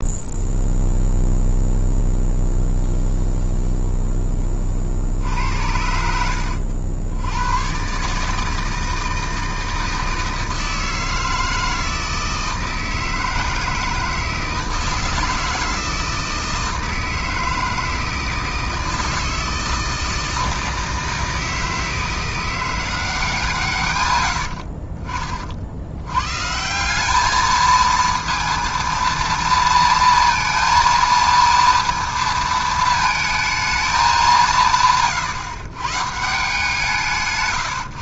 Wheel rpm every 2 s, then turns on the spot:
0, 0, 20, 70, 160, 160, 160, 160, 160, 160, 160, 170, 70, 140, 230, 230, 220, 170, 170.
24-26